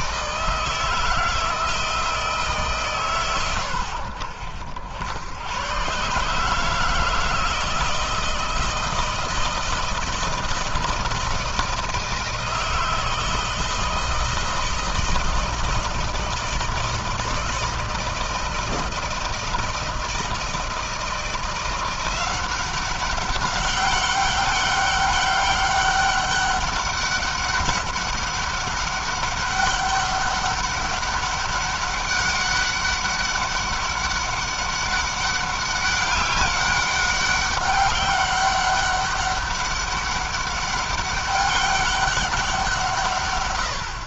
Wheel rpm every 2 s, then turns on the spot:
160, 150, 80, 160, 160, 160, 160, 160, 160, 160, 160, 180, 190, 200, 190, 200, 200, 200, 200, 200, 200, 160.
none